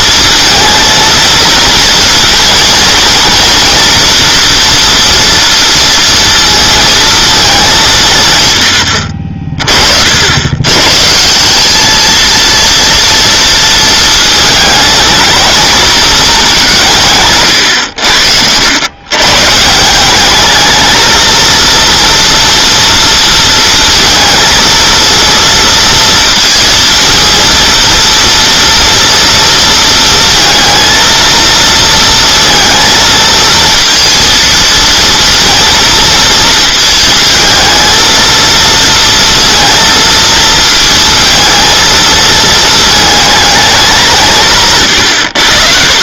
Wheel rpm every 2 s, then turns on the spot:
230, 230, 230, 230, 110, 120, 230, 220, 180, 90, 220, 230, 230, 230, 230, 230, 230, 230, 220, 230, 230, 220, 140.
none